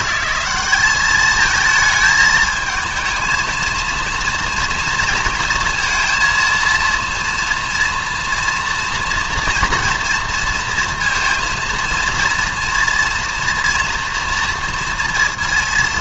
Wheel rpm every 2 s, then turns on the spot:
200, 220, 240, 230, 240, 230, 230, 230.
none